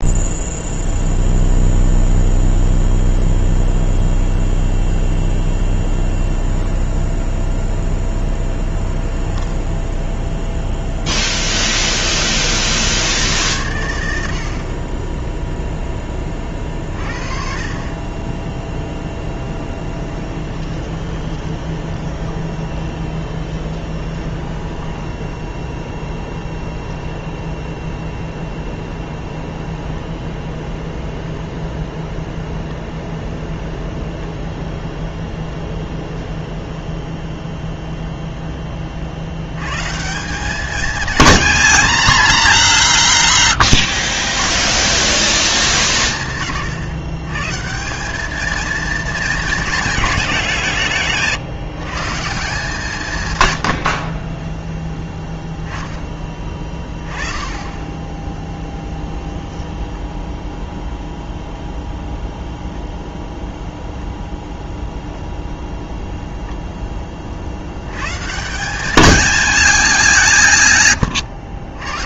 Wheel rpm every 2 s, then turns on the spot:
0, 0, 0, 0, 0, 0, 90, 10, 40, 10, 20, 20, 10, 0, 10, 0, 0, 0, 0, 80, 220, 160, 200, 140, 210, 150, 130, 10, 10, 10, 0, 0, 0, 50, 220, 120.
18-26